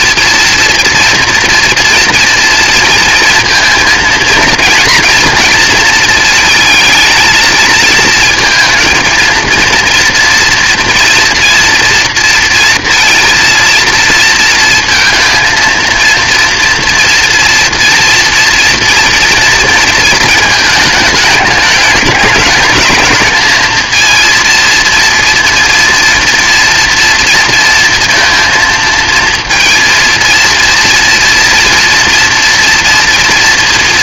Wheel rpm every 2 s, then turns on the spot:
230, 230, 230, 230, 230, 240, 230, 230, 230, 230, 220, 210, 230, 230, 230, 230, 230.
none